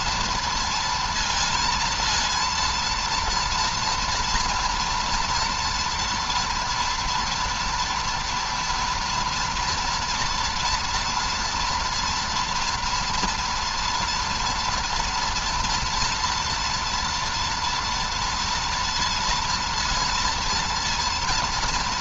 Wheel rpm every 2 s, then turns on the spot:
230, 230, 230, 230, 230, 230, 230, 240, 240, 230, 230.
none